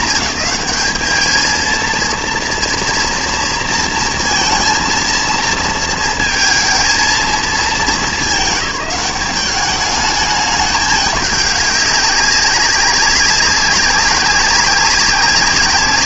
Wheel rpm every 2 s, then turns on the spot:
220, 230, 230, 230, 200, 210, 200, 190.
none